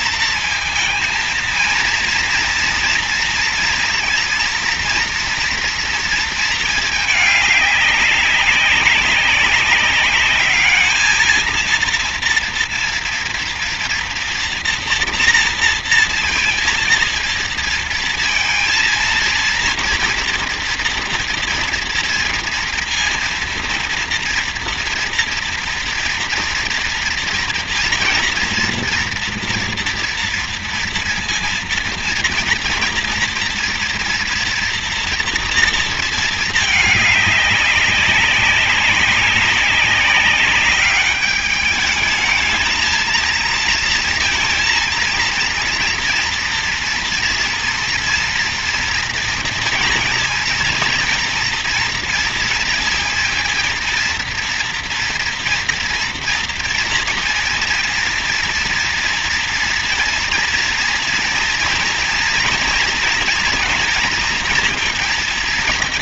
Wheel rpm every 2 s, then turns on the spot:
230, 230, 230, 220, 190, 210, 230, 240, 230, 230, 230, 230, 230, 230, 230, 230, 230, 230, 210, 190, 200, 220, 230, 240, 230, 240, 230, 230, 240, 230, 230, 230, 230.
none